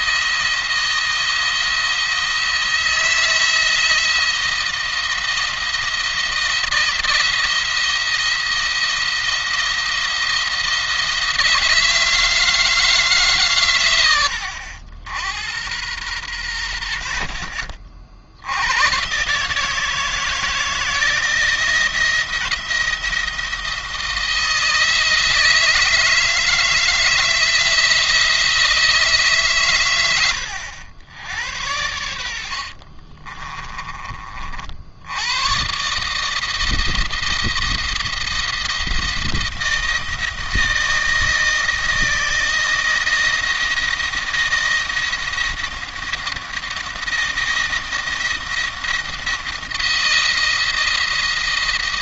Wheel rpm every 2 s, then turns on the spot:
170, 170, 170, 170, 170, 170, 160, 80, 90, 90, 160, 170, 160, 160, 160, 90, 60, 50, 160, 170, 170, 170, 170, 170, 170, 170.
32-34